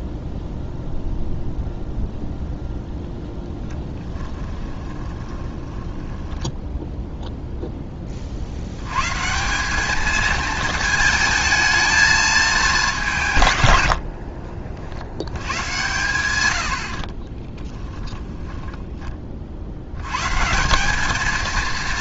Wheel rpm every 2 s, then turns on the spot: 0, 0, 20, 0, 100, 220, 200, 60, 70, 30, 180.
4-6 16-20